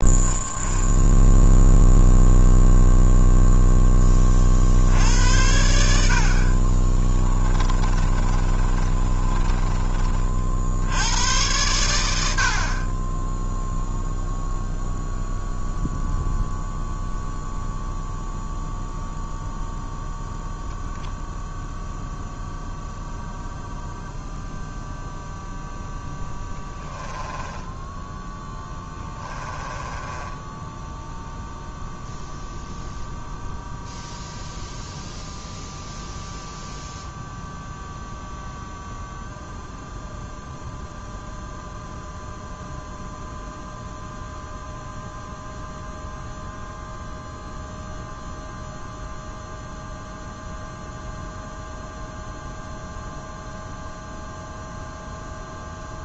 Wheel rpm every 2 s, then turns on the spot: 0, 0, 60, 30, 30, 70, 40, 0, 0, 0, 0, 0, 0, 10, 10, 10, 0, 0, 0, 0, 0, 0, 0, 0, 0, 0, 0, 0.
6-10 26-32